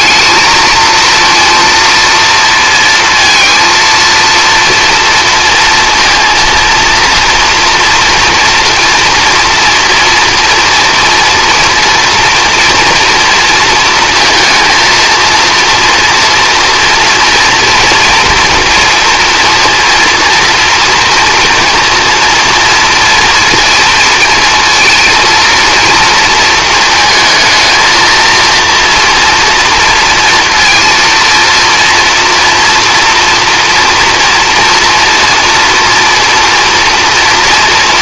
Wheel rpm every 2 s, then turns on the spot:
230, 230, 230, 230, 230, 230, 230, 230, 240, 230, 230, 230, 230, 220, 230, 230, 240, 230, 230.
none